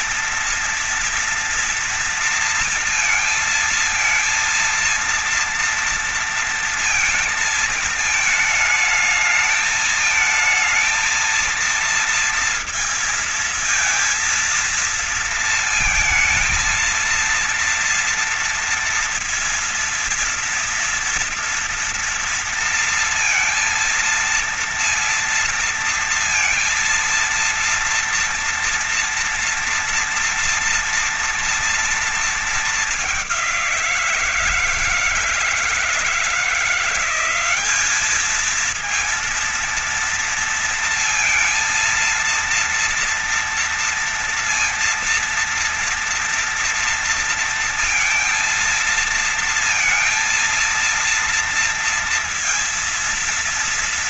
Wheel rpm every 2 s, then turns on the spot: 230, 230, 230, 230, 220, 220, 230, 230, 230, 230, 230, 230, 230, 230, 230, 230, 230, 170, 170, 210, 230, 230, 230, 230, 230, 230, 230.
none